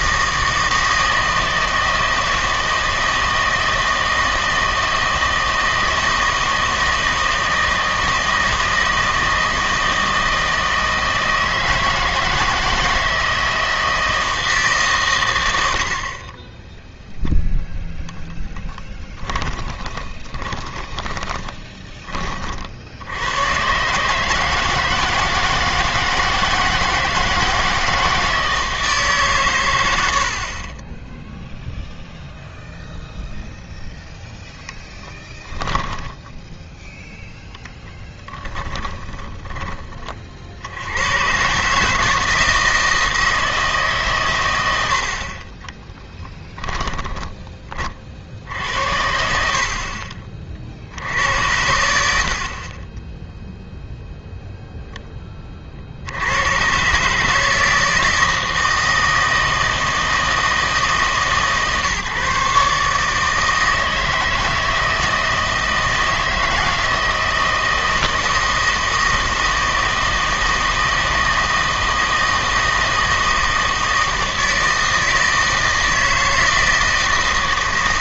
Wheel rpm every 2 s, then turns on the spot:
160, 160, 160, 160, 160, 160, 160, 150, 10, 10, 20, 60, 160, 160, 160, 20, 0, 0, 0, 10, 80, 160, 90, 10, 70, 50, 30, 0, 120, 160, 160, 150, 160, 160, 160, 160, 160, 160, 160.
18-22 38-40 46-48